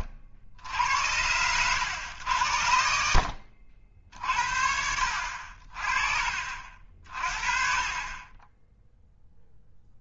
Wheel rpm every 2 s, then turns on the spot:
80, 80, 60, 50, 10.
none